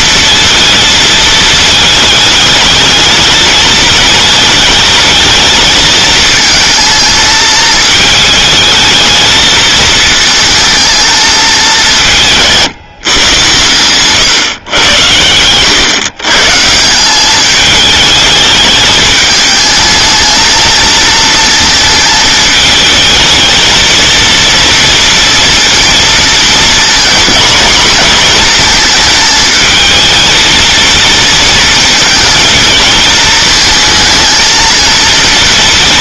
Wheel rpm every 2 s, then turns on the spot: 230, 210, 210, 230, 220, 220, 160, 120, 160, 210, 230, 220, 230, 240, 230, 230, 230, 220.
none